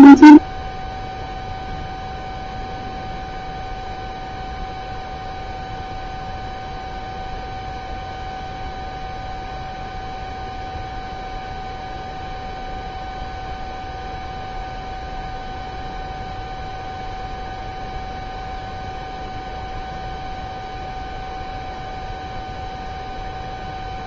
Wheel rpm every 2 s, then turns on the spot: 0, 0, 0, 0, 0, 0, 0, 0, 0, 0, 0, 0.
none